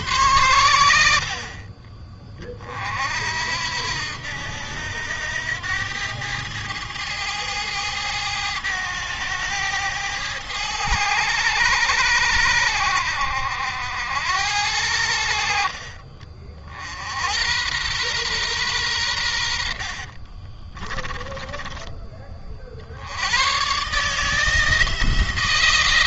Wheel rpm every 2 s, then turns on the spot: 90, 40, 80, 110, 110, 100, 80, 80, 60, 110, 30, 50, 160.
20-22